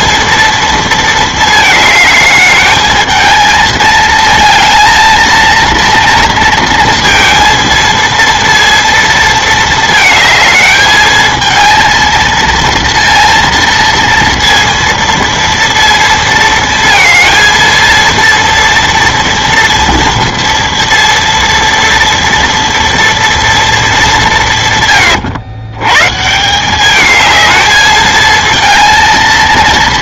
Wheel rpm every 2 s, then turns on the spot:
230, 220, 230, 230, 230, 220, 230, 230, 230, 230, 230, 230, 160, 180, 230.
none